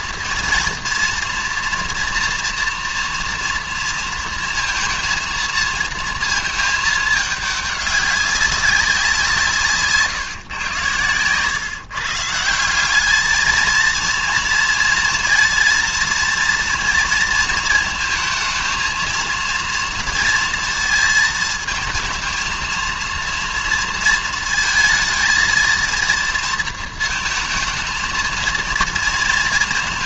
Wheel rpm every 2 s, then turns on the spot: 230, 240, 230, 220, 190, 120, 180, 230, 230, 220, 230, 230, 230, 230, 230.
none